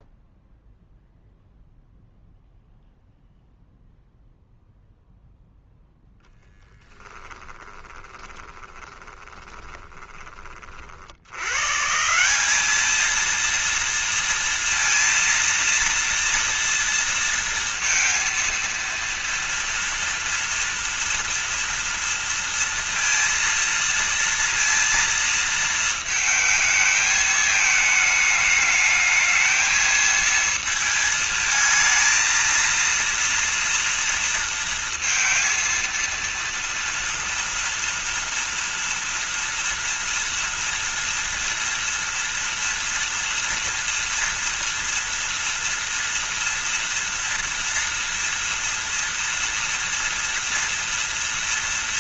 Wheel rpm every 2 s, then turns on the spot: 0, 0, 0, 10, 20, 30, 190, 230, 230, 230, 230, 230, 230, 220, 210, 220, 230, 230, 230, 230, 230, 230, 230, 230, 230, 230.
8-10